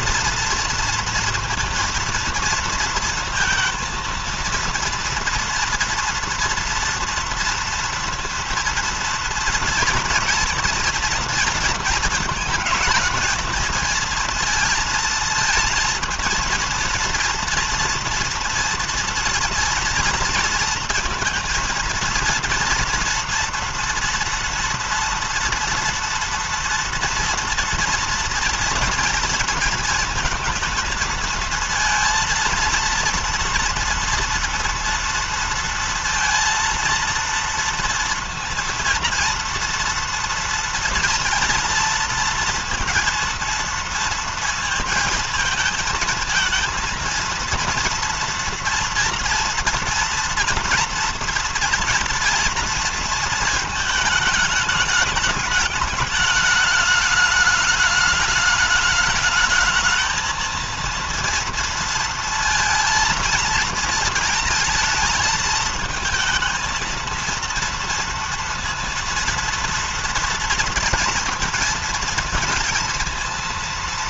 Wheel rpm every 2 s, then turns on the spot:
230, 230, 230, 230, 230, 230, 220, 230, 230, 230, 230, 230, 230, 230, 230, 220, 230, 230, 230, 230, 230, 230, 230, 230, 230, 230, 230, 210, 210, 210, 230, 230, 220, 220, 230, 230, 230.
none